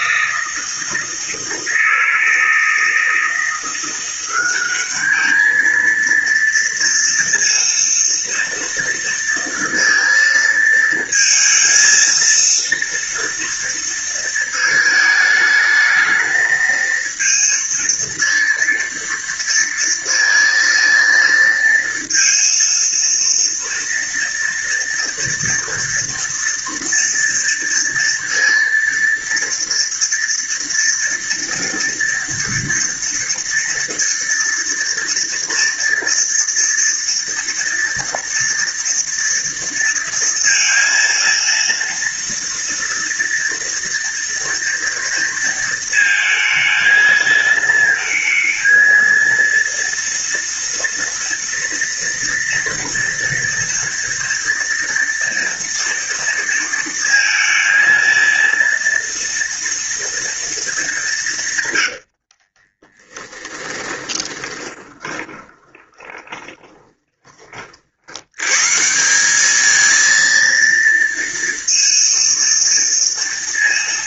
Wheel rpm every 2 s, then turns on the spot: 160, 160, 210, 230, 230, 220, 230, 220, 220, 230, 230, 230, 230, 230, 230, 230, 230, 230, 230, 230, 230, 230, 230, 220, 230, 230, 230, 230, 230, 230, 190, 10, 20, 20, 160, 230, 230.
62-68